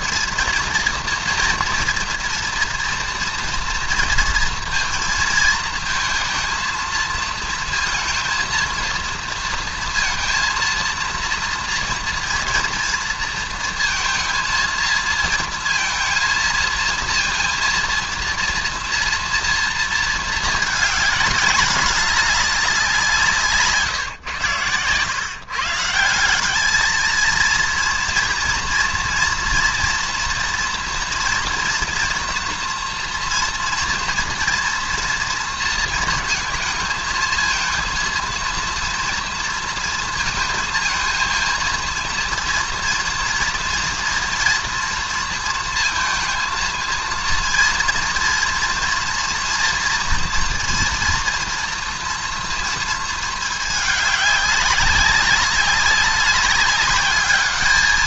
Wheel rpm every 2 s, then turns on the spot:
230, 230, 230, 230, 230, 230, 230, 230, 230, 230, 230, 200, 140, 170, 230, 240, 230, 230, 220, 230, 230, 230, 240, 230, 230, 240, 230, 200, 200.
none